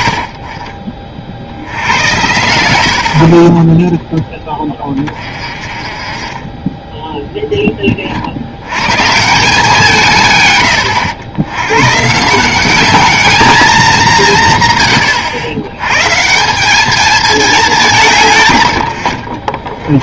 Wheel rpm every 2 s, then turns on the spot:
30, 50, 30, 10, 140, 90, 210, 110, 210, 60.
none